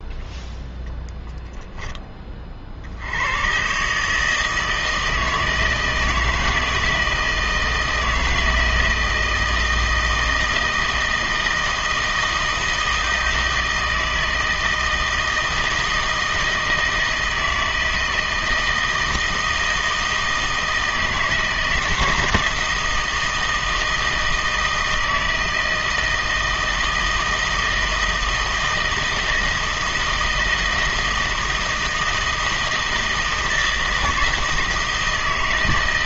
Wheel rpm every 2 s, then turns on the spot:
0, 50, 160, 160, 160, 160, 160, 160, 160, 160, 160, 160, 160, 160, 160, 160, 160, 160.
none